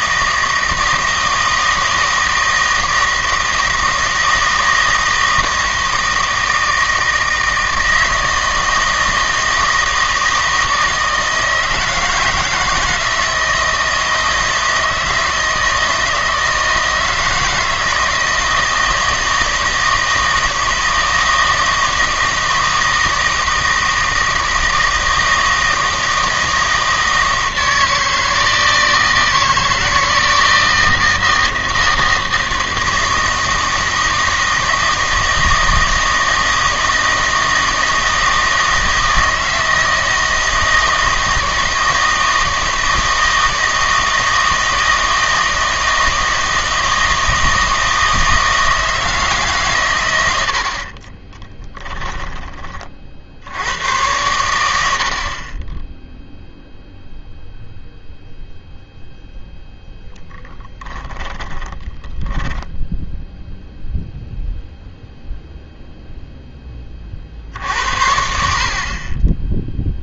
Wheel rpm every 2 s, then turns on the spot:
160, 160, 160, 160, 160, 160, 160, 160, 160, 160, 160, 160, 160, 160, 160, 170, 160, 160, 160, 160, 160, 160, 160, 160, 160, 80, 30, 90, 0, 0, 10, 10, 0, 20, 60.
62-64